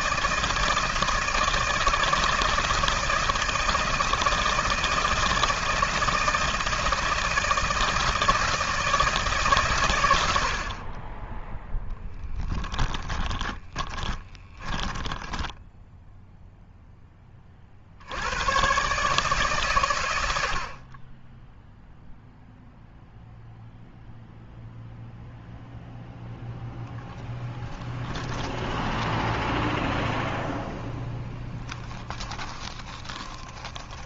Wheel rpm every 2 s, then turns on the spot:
160, 160, 160, 160, 160, 40, 10, 10, 0, 130, 40, 0, 0, 0, 10, 0, 20.
12-16 28-30 32-34